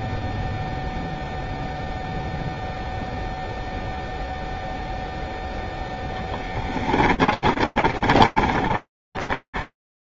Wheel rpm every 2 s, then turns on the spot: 0, 0, 0, 20, 10.
6-10